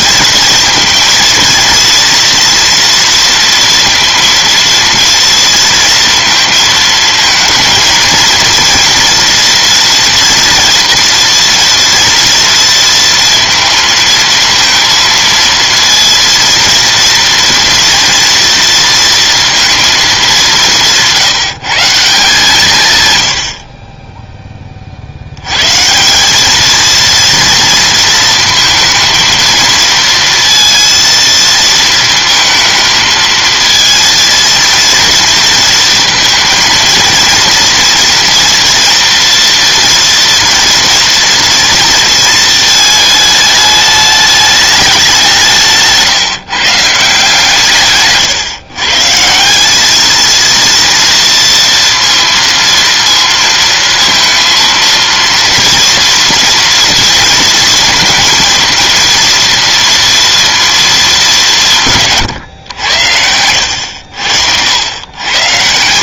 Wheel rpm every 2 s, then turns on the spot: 230, 230, 230, 230, 230, 240, 230, 230, 230, 230, 160, 120, 50, 230, 230, 230, 230, 230, 230, 230, 230, 220, 200, 160, 150, 230, 230, 230, 230, 230, 220, 100, 90.
62-64